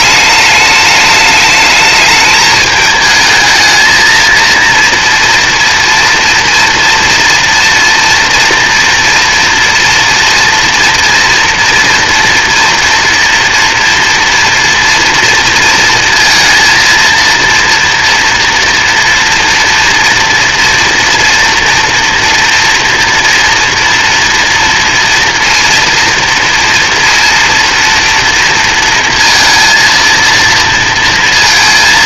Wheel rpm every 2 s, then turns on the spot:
210, 210, 230, 230, 230, 230, 240, 230, 230, 230, 240, 240, 230, 230, 230, 230.
none